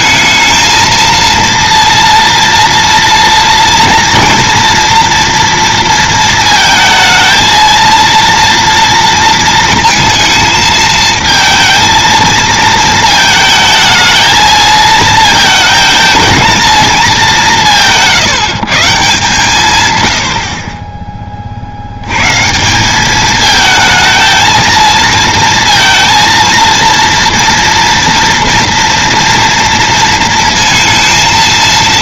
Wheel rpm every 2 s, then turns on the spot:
220, 230, 230, 220, 230, 220, 220, 220, 230, 150, 50, 160, 230, 230, 230, 230.
none